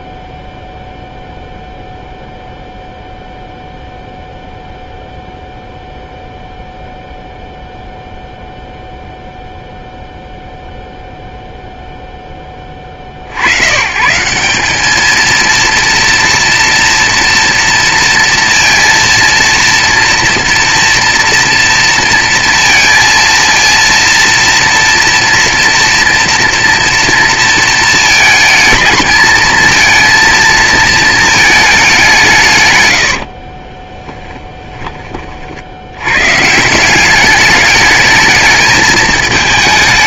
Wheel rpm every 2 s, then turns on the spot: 0, 0, 0, 0, 0, 0, 20, 190, 230, 230, 230, 230, 240, 230, 220, 230, 130, 10, 170, 220.
none